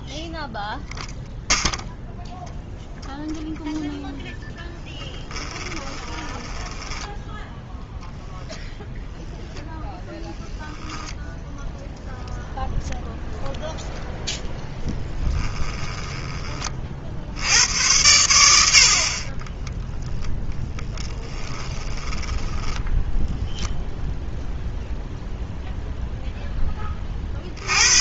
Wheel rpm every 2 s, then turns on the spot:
0, 0, 10, 10, 0, 10, 0, 0, 50, 50, 10, 10, 0, 20.
6-8 20-24